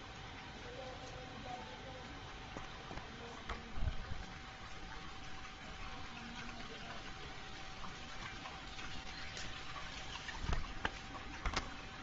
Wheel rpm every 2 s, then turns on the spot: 0, 0, 0, 0, 0, 0.
none